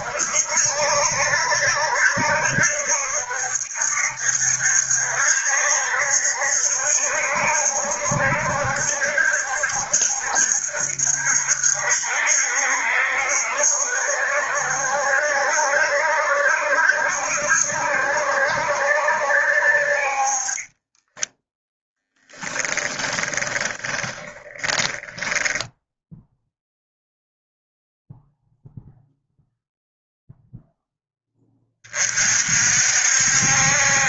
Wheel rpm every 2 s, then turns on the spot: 70, 70, 70, 70, 70, 70, 70, 70, 70, 70, 20, 20, 20, 0, 0, 10, 60.
20-26